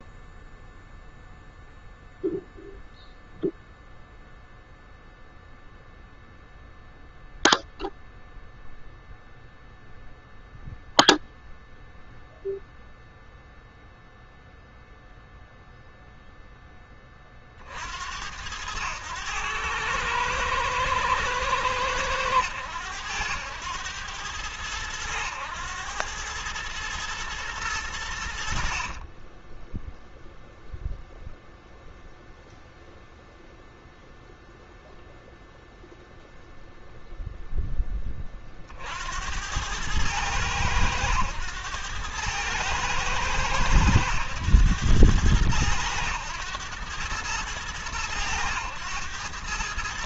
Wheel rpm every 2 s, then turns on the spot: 0, 0, 0, 0, 0, 0, 0, 0, 20, 100, 110, 100, 100, 110, 30, 0, 0, 0, 0, 70, 100, 110, 100, 110, 110.
none